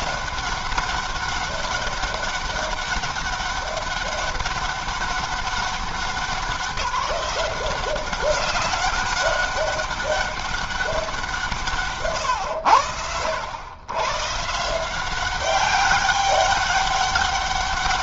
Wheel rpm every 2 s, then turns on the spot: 190, 200, 200, 190, 190, 200, 110, 150, 200.
none